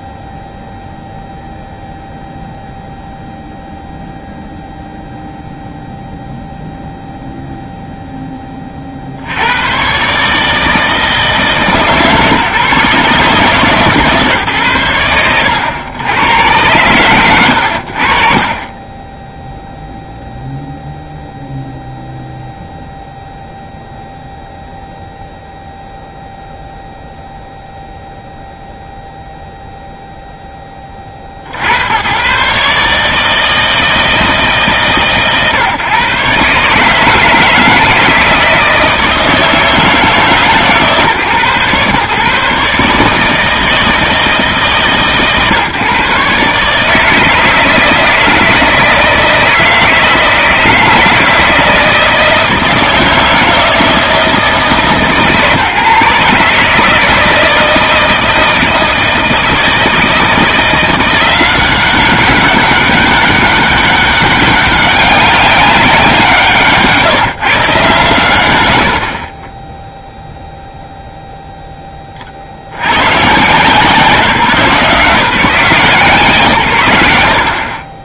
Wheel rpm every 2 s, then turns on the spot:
0, 0, 0, 0, 30, 160, 150, 100, 100, 20, 0, 0, 0, 0, 0, 40, 140, 150, 150, 160, 130, 150, 150, 150, 160, 160, 160, 160, 160, 160, 170, 190, 200, 170, 120, 0, 60, 150, 100.
none